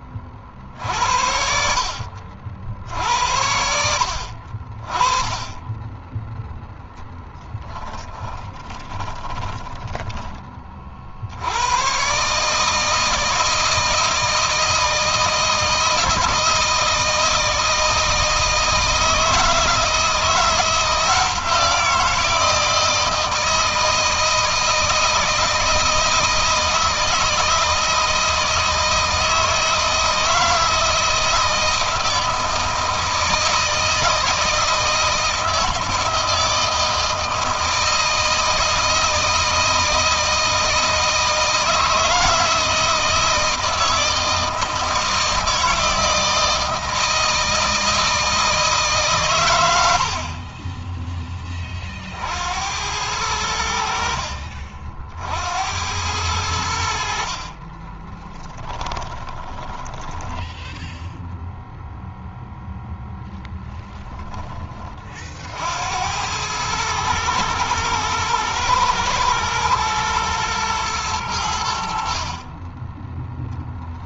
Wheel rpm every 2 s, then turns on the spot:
60, 60, 30, 0, 20, 50, 160, 160, 160, 160, 170, 160, 160, 160, 160, 160, 160, 160, 160, 160, 160, 160, 160, 160, 150, 20, 80, 50, 60, 20, 0, 0, 30, 110, 110, 110, 20.
8-10 56-60